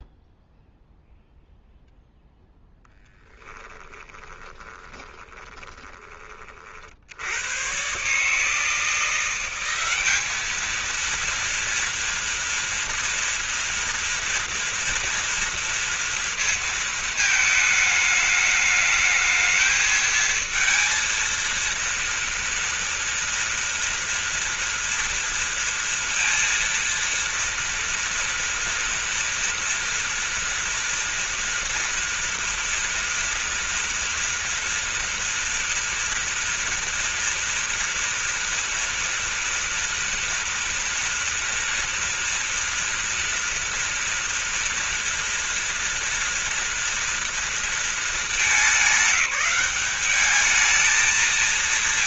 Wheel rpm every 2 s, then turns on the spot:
0, 0, 20, 30, 150, 210, 230, 230, 230, 210, 220, 230, 230, 230, 230, 230, 230, 230, 230, 230, 240, 230, 230, 230, 200, 210.
4-6